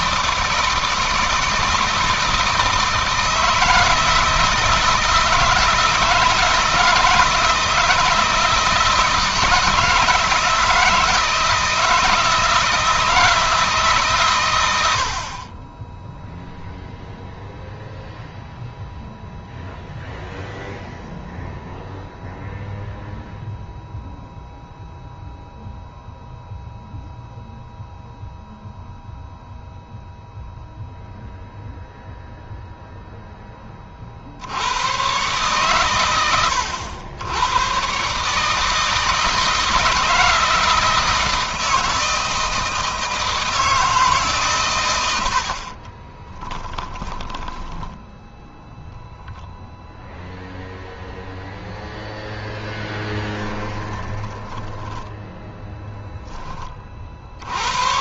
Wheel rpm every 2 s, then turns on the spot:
160, 160, 160, 160, 160, 160, 160, 80, 0, 0, 0, 0, 0, 0, 0, 0, 0, 110, 100, 160, 160, 160, 90, 10, 0, 0, 10, 10, 50.
46-48 52-56